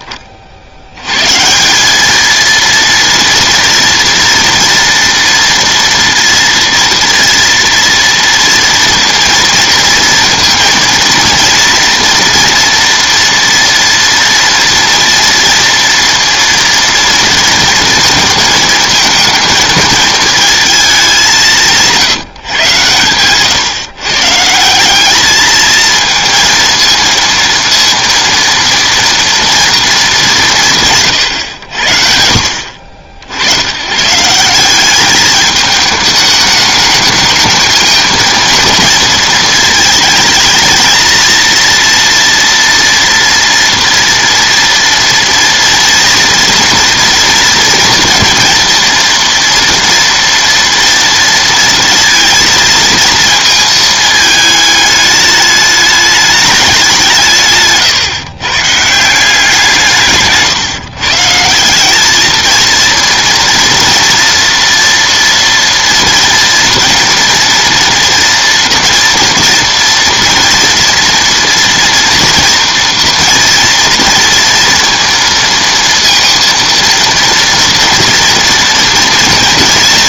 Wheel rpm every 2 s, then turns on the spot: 40, 220, 230, 230, 230, 230, 230, 230, 230, 230, 220, 140, 160, 230, 230, 180, 70, 170, 210, 230, 220, 230, 230, 230, 230, 230, 230, 220, 200, 140, 150, 230, 240, 230, 230, 240, 240, 230, 230, 230.
32-34